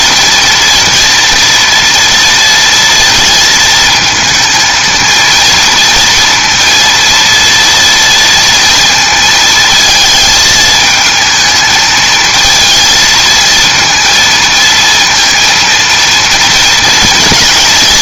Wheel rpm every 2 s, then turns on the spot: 230, 230, 230, 230, 230, 220, 220, 230, 230.
none